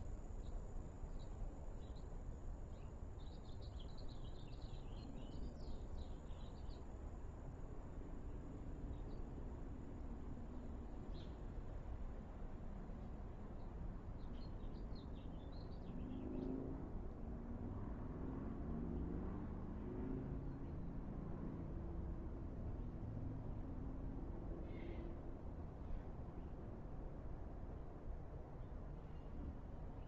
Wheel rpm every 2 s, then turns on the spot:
0, 0, 0, 0, 0, 0, 0, 0, 0, 0, 0, 0, 0, 0, 0.
none